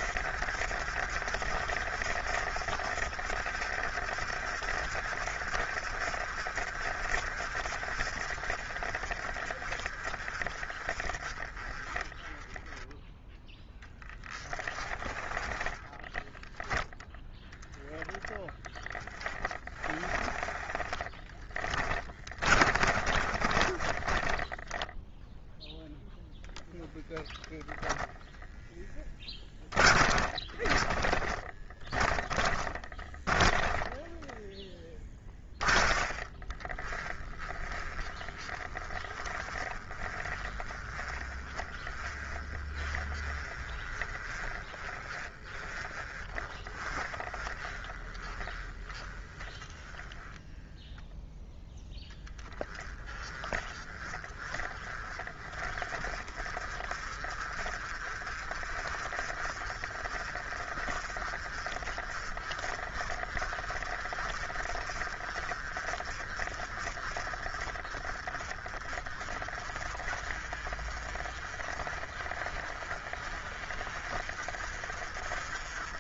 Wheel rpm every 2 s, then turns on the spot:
50, 50, 50, 50, 40, 30, 10, 30, 0, 20, 20, 30, 20, 10, 10, 30, 10, 10, 30, 30, 30, 30, 30, 30, 20, 0, 20, 30, 40, 40, 40, 40, 40, 40, 30, 40, 40, 40.
20-26 28-50